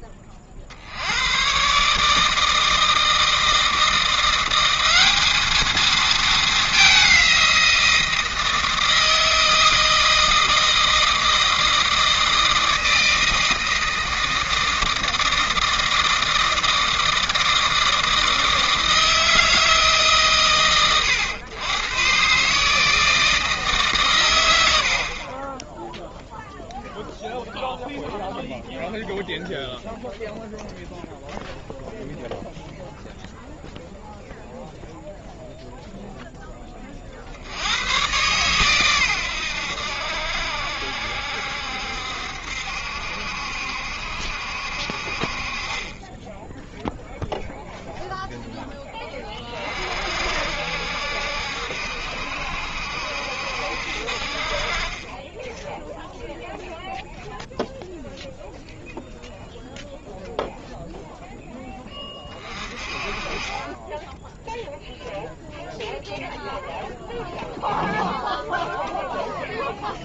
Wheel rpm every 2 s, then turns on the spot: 60, 160, 190, 200, 160, 160, 160, 160, 160, 160, 120, 150, 70, 0, 0, 0, 0, 0, 20, 120, 70, 70, 60, 0, 10, 60, 70, 30, 0, 0, 0, 30, 0, 0, 0.
none